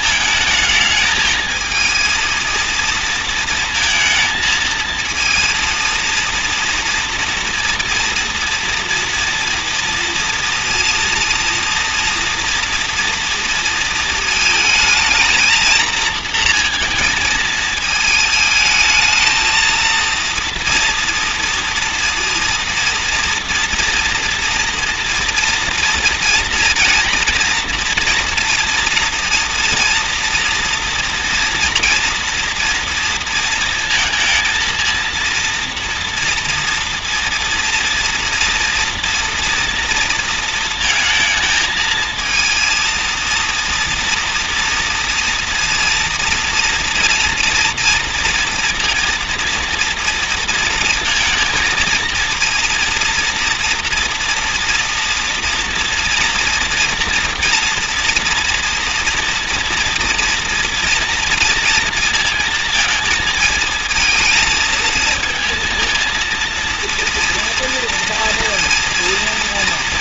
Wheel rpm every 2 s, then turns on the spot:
220, 230, 220, 230, 230, 230, 230, 220, 230, 220, 230, 230, 230, 230, 230, 230, 230, 230, 230, 230, 220, 230, 230, 230, 230, 230, 230, 230, 230, 230, 230, 220, 220, 230, 230.
none